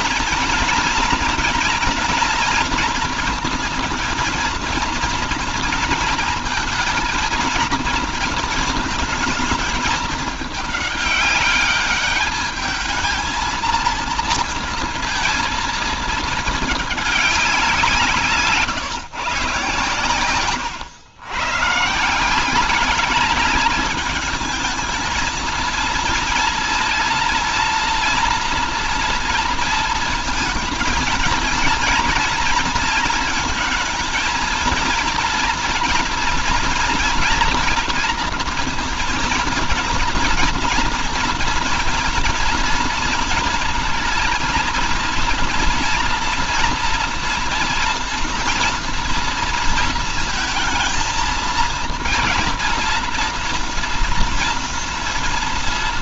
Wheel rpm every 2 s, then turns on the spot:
230, 230, 230, 230, 230, 210, 220, 230, 210, 150, 110, 200, 220, 230, 230, 230, 230, 230, 230, 230, 230, 230, 230, 240, 230, 230, 230, 230.
none